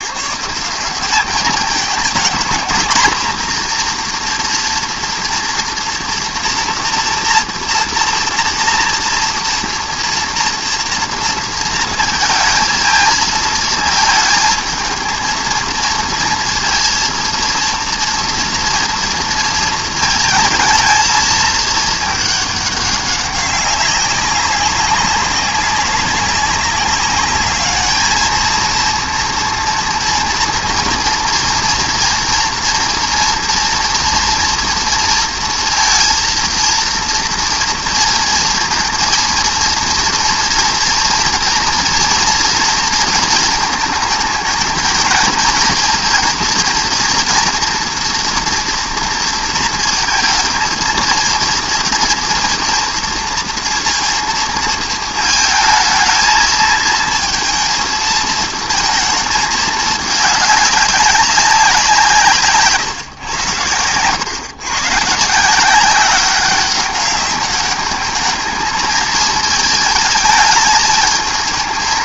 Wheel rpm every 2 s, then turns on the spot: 170, 230, 240, 230, 230, 230, 230, 220, 230, 240, 220, 200, 190, 200, 230, 230, 230, 230, 230, 230, 230, 230, 220, 230, 240, 220, 230, 230, 220, 230, 210, 150, 130, 200, 220, 220.
none